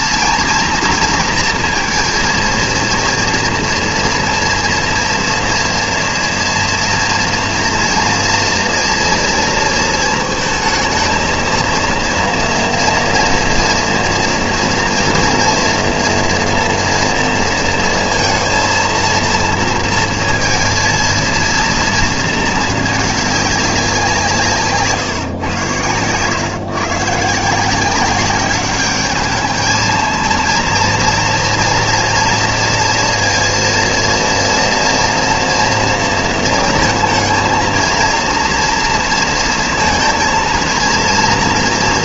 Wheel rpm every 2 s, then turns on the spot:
240, 230, 230, 230, 230, 220, 230, 230, 240, 230, 230, 220, 160, 130, 200, 230, 230, 240, 230, 230, 230.
none